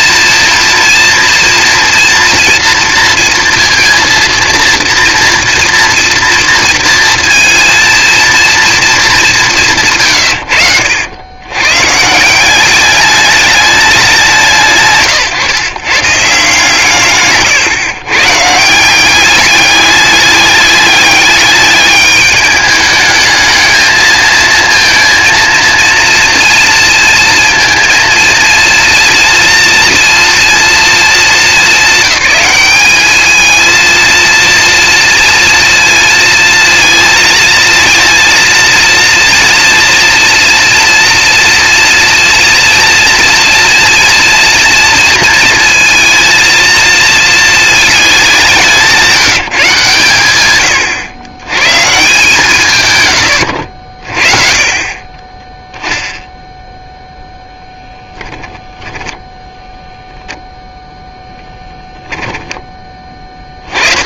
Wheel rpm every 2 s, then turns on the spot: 240, 230, 230, 230, 210, 90, 200, 120, 140, 190, 200, 210, 230, 230, 230, 220, 210, 240, 230, 230, 230, 230, 230, 220, 180, 100, 120, 30, 0, 10, 0, 10.
none